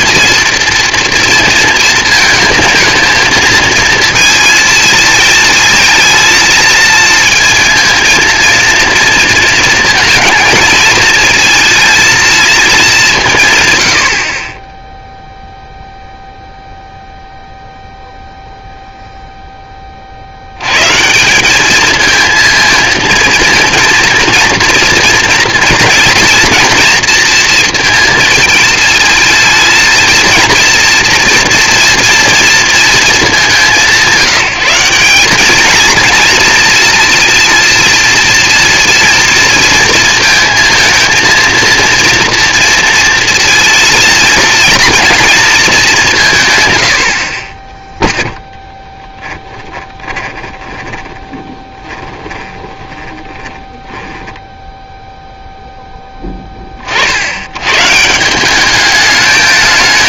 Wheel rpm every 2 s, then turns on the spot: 240, 220, 220, 230, 230, 220, 210, 20, 0, 0, 100, 230, 230, 230, 220, 230, 230, 180, 230, 230, 220, 230, 220, 120, 10, 20, 20, 10, 20, 200.
50-54